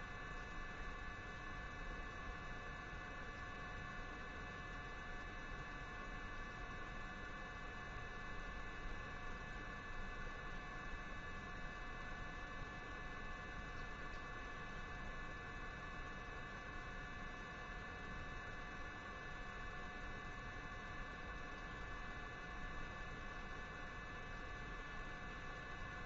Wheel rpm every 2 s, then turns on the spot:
0, 0, 0, 0, 0, 0, 0, 0, 0, 0, 0, 0, 0.
none